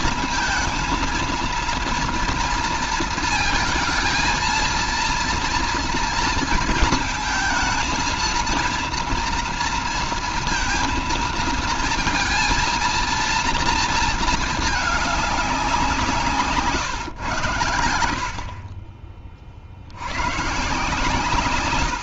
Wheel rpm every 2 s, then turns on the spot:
230, 230, 230, 230, 230, 230, 230, 220, 160, 40, 120.
none